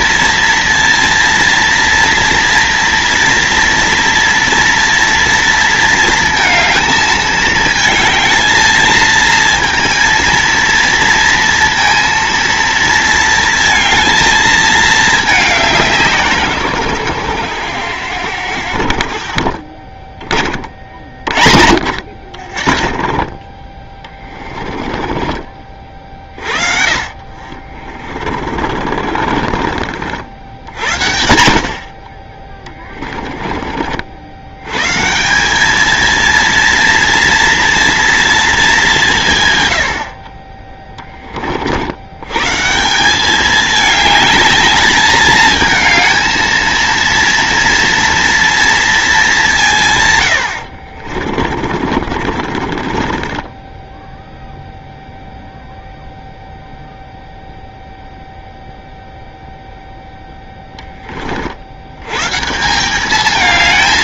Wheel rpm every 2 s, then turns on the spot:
230, 240, 240, 220, 230, 230, 230, 220, 130, 80, 50, 50, 20, 30, 40, 60, 20, 100, 230, 210, 20, 140, 220, 230, 230, 70, 30, 0, 0, 0, 10, 160.
22-26 28-30 32-34 50-54